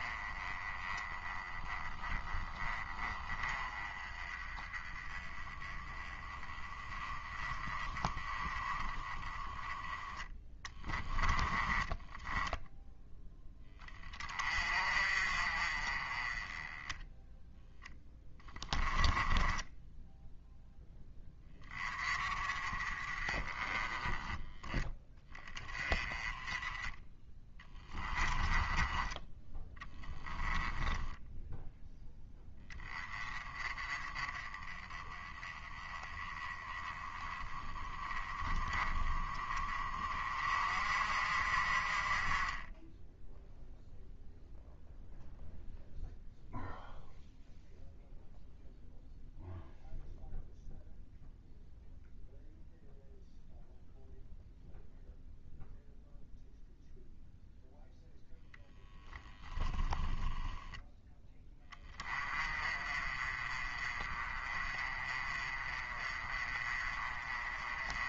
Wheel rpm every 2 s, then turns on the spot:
20, 20, 20, 20, 20, 10, 10, 40, 10, 10, 10, 30, 10, 20, 20, 10, 10, 20, 20, 20, 40, 10, 0, 0, 0, 0, 0, 0, 0, 0, 10, 30, 30, 30.
10-12 18-20 26-30